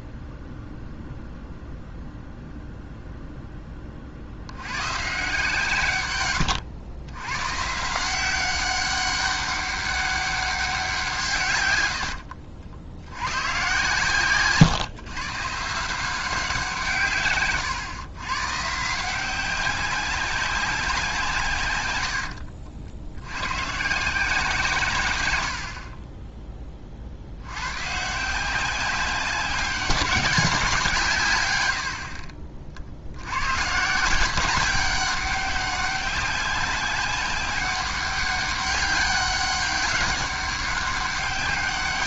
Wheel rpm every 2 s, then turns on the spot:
0, 0, 100, 100, 190, 190, 60, 140, 170, 150, 190, 70, 150, 30, 180, 180, 60, 190, 190, 200, 200.
none